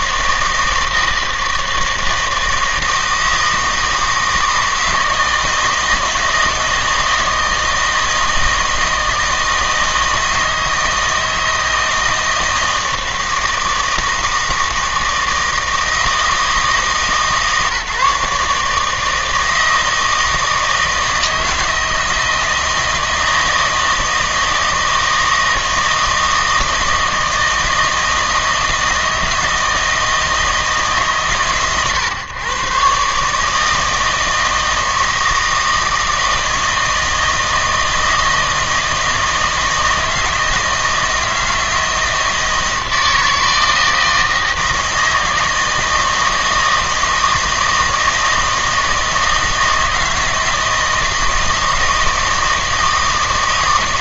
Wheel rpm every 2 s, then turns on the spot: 160, 160, 160, 160, 160, 160, 160, 160, 160, 150, 160, 160, 160, 160, 160, 150, 130, 160, 160, 160, 160, 160, 160, 160, 160, 160, 160.
none